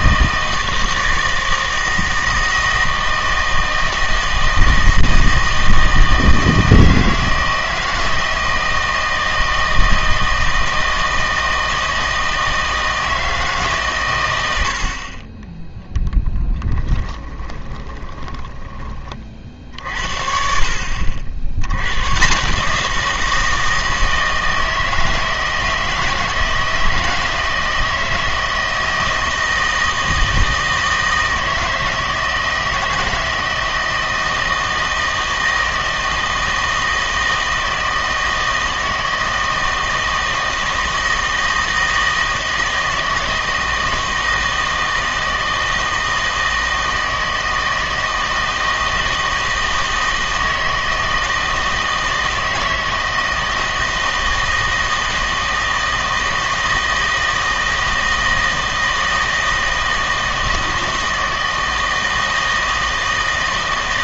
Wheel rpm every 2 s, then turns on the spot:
160, 160, 160, 160, 160, 160, 160, 80, 10, 20, 60, 160, 160, 160, 160, 160, 160, 160, 160, 160, 160, 160, 160, 160, 160, 160, 160, 160, 160, 160, 160, 160.
16-18